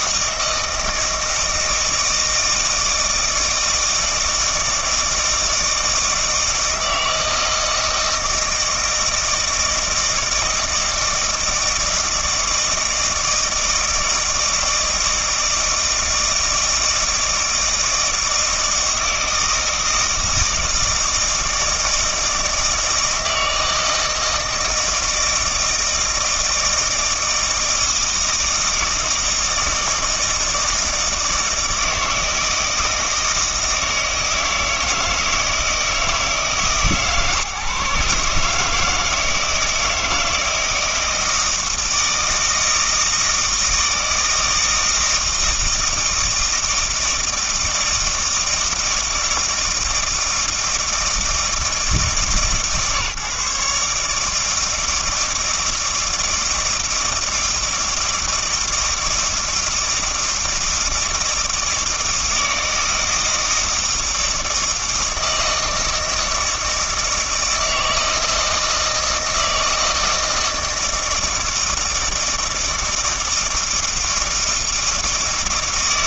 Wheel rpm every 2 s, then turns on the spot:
160, 160, 160, 160, 160, 160, 160, 160, 160, 160, 160, 160, 160, 160, 160, 160, 160, 160, 150, 150, 160, 160, 160, 160, 160, 160, 140, 160, 160, 160, 160, 160, 160, 160, 160, 160, 160, 160.
none